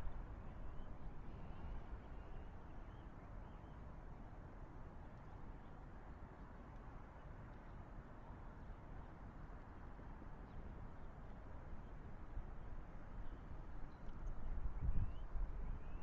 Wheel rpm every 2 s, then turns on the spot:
0, 0, 0, 0, 0, 0, 0, 0.
none